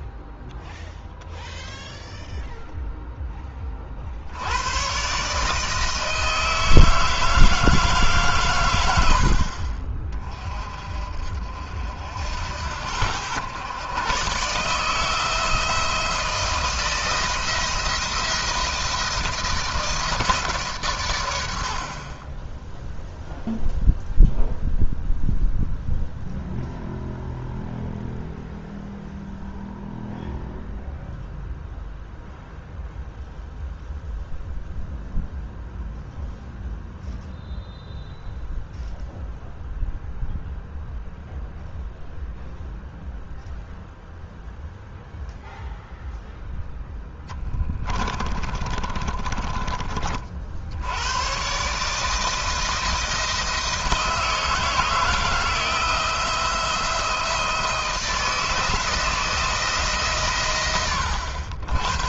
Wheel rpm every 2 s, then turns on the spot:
0, 0, 120, 160, 100, 40, 80, 150, 160, 160, 130, 10, 0, 0, 0, 0, 0, 0, 0, 0, 0, 0, 0, 0, 30, 70, 160, 160, 170, 170, 100.
48-50